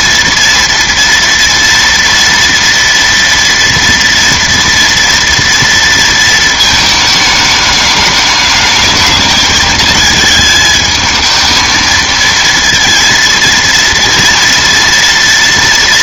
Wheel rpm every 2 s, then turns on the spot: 230, 230, 230, 220, 210, 220, 230, 230.
none